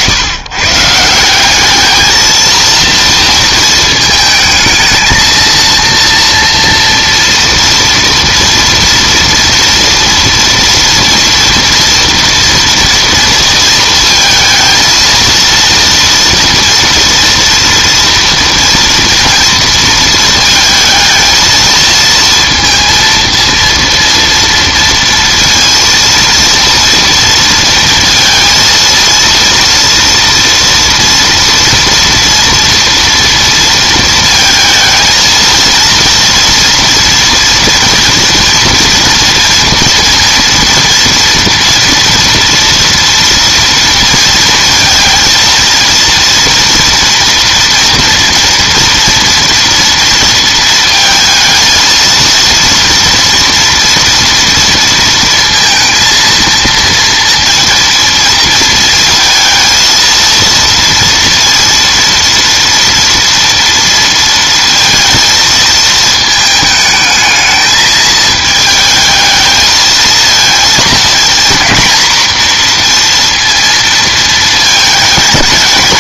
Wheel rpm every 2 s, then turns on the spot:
140, 230, 220, 230, 230, 230, 230, 220, 230, 230, 220, 230, 230, 230, 230, 230, 230, 220, 230, 230, 230, 230, 230, 230, 230, 230, 230, 230, 230, 230, 230, 230, 230, 220, 220, 220, 230, 220.
none